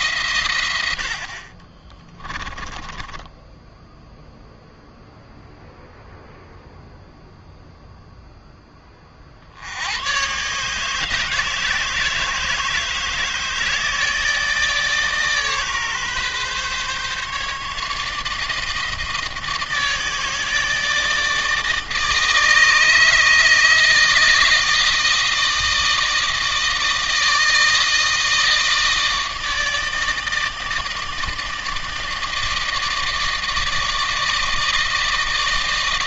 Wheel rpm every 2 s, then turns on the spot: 130, 20, 0, 0, 20, 140, 160, 150, 140, 160, 150, 160, 160, 160, 160, 160, 160, 160.
2-4